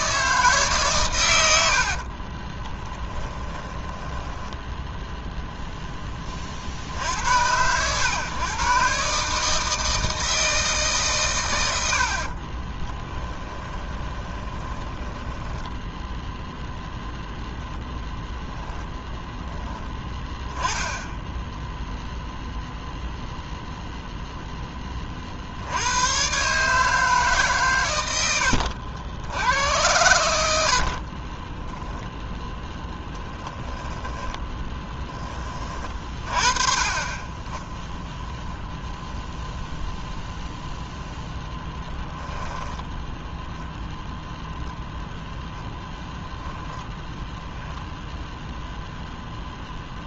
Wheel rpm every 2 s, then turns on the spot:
140, 20, 10, 60, 130, 140, 20, 20, 0, 0, 10, 0, 20, 150, 70, 60, 10, 10, 30, 0, 0, 10, 0, 0, 0.
2-4 12-16 30-32 42-44